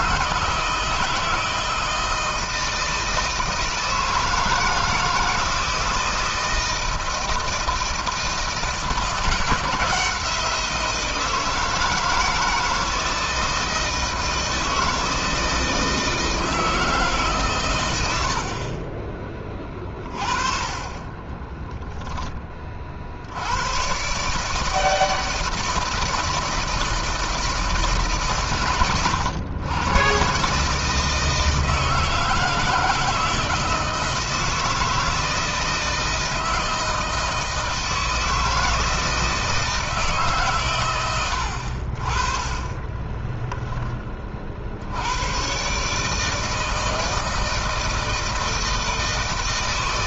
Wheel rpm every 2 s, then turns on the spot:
160, 160, 160, 160, 160, 170, 160, 160, 160, 50, 30, 30, 150, 160, 120, 140, 160, 160, 160, 160, 120, 30, 60, 160, 160.
18-20 42-44